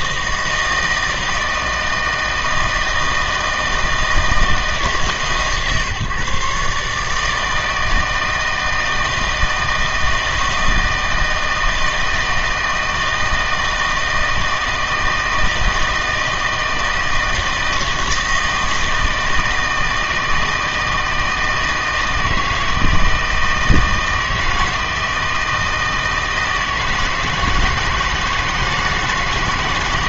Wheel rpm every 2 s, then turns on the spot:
160, 160, 160, 140, 160, 160, 160, 160, 160, 160, 160, 160, 160, 160, 160.
none